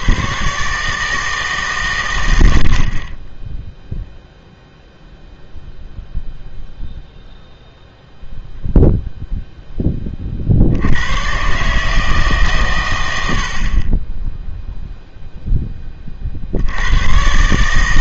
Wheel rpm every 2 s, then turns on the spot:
140, 70, 0, 0, 0, 60, 130, 0, 80.
none